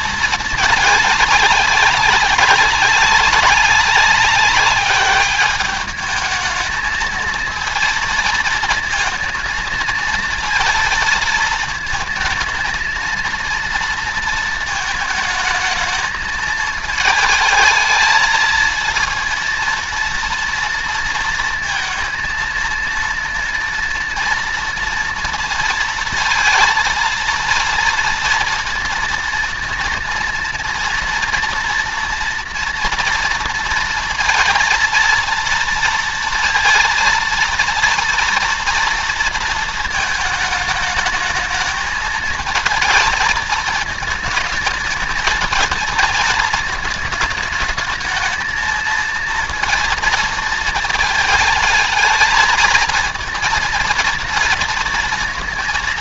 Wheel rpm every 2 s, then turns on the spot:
200, 190, 200, 220, 220, 230, 230, 220, 220, 230, 230, 230, 230, 230, 230, 230, 230, 230, 230, 230, 210, 220, 220, 220, 230, 220, 230, 230.
none